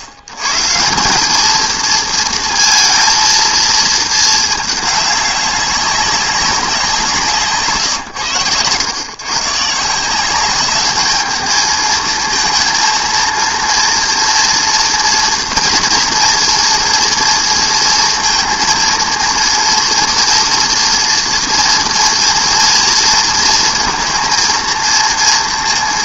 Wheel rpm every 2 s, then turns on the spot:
110, 230, 220, 190, 110, 200, 230, 230, 230, 230, 230, 230, 220.
none